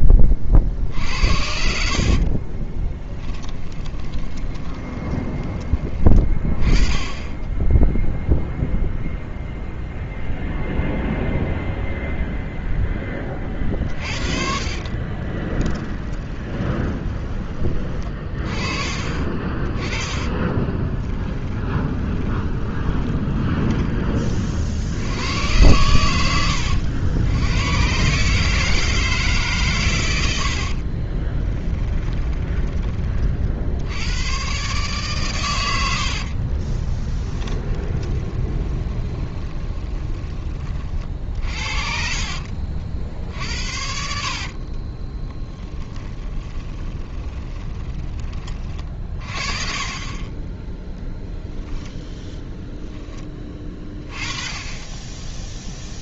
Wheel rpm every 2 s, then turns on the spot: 40, 20, 20, 20, 0, 0, 10, 40, 20, 40, 20, 10, 60, 90, 150, 60, 30, 130, 30, 20, 40, 70, 40, 10, 40, 10, 10, 20.
2-6 14-18 20-24 30-32 36-40 44-48